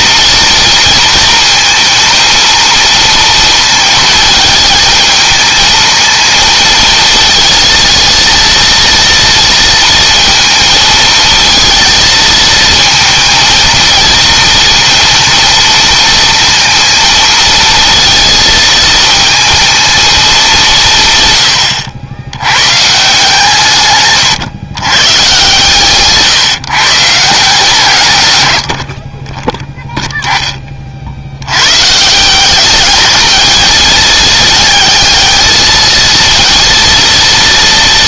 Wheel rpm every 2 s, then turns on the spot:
230, 230, 220, 220, 230, 220, 220, 230, 230, 220, 170, 130, 120, 150, 60, 40, 210, 220, 230.
none